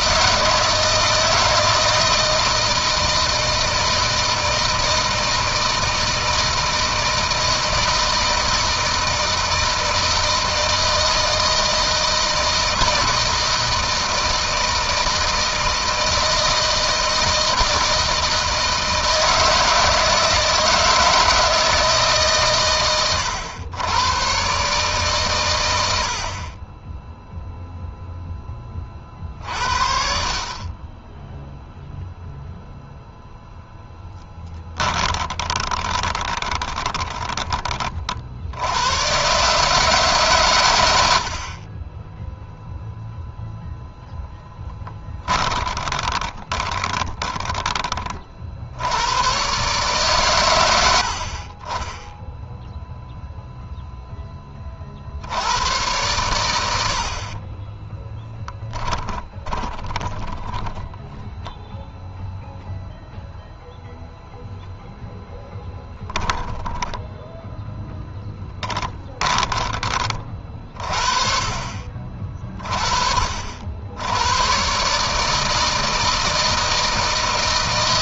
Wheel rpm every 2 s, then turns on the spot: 160, 160, 160, 160, 160, 160, 160, 160, 160, 160, 160, 120, 130, 30, 20, 20, 0, 10, 20, 80, 110, 0, 10, 20, 70, 100, 0, 20, 90, 20, 10, 0, 0, 10, 10, 40, 30, 120, 160.
34-38 44-48 58-62 66-70